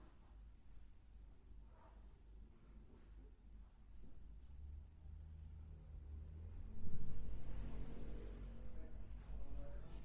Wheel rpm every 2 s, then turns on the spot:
0, 0, 0, 0, 0.
none